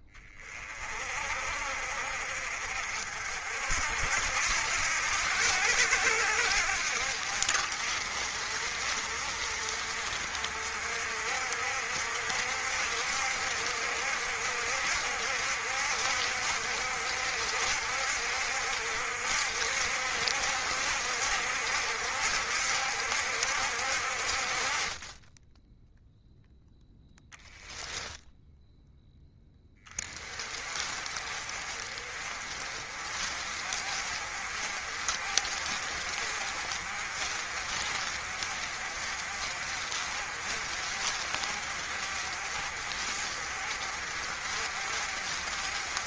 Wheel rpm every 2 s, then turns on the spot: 40, 50, 80, 60, 50, 60, 60, 60, 60, 70, 70, 70, 30, 0, 0, 30, 40, 50, 50, 50, 50, 50, 50.
none